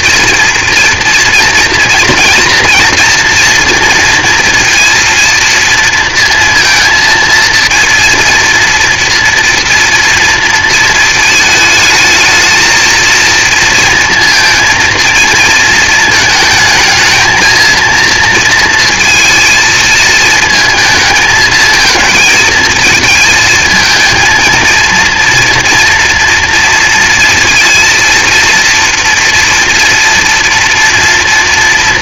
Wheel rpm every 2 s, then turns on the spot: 230, 240, 230, 230, 240, 230, 230, 230, 220, 230, 220, 220, 230, 230, 230, 230.
none